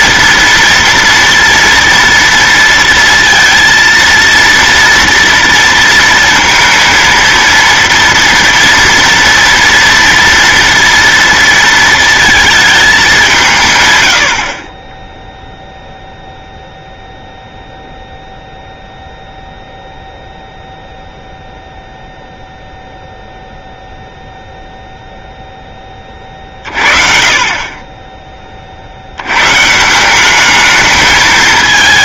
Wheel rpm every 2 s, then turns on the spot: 230, 230, 230, 230, 230, 230, 210, 30, 0, 0, 0, 0, 0, 40, 60, 220.
none